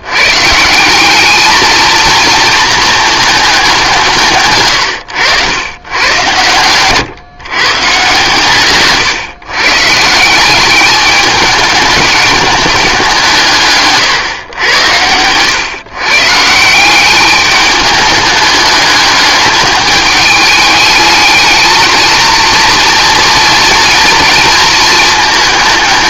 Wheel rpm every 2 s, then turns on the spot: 180, 220, 110, 130, 140, 200, 200, 100, 180, 210, 220, 230, 220.
4-6 8-10